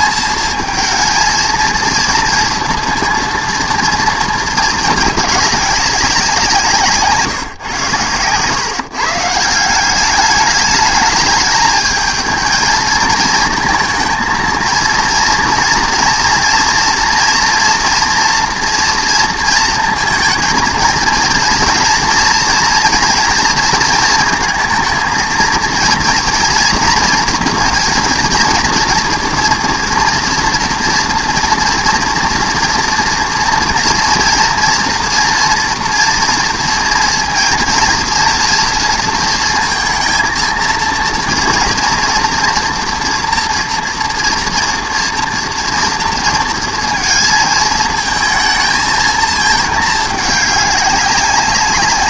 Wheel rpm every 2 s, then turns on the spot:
230, 230, 210, 150, 140, 220, 220, 230, 230, 230, 220, 230, 230, 240, 230, 240, 230, 230, 230, 230, 230, 230, 230, 230, 220, 200.
none